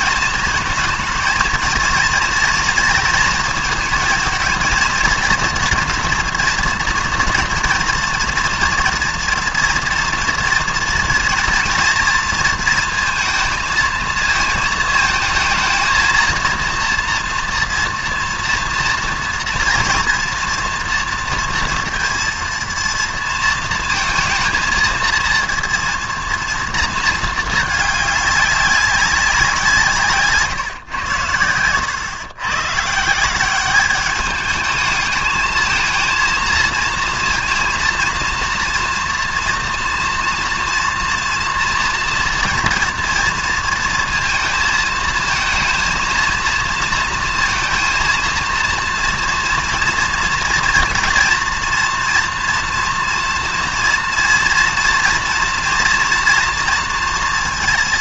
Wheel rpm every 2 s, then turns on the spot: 220, 220, 230, 230, 230, 230, 230, 220, 230, 230, 230, 230, 230, 230, 200, 120, 140, 220, 230, 230, 230, 240, 220, 230, 230, 240, 230, 230, 230.
none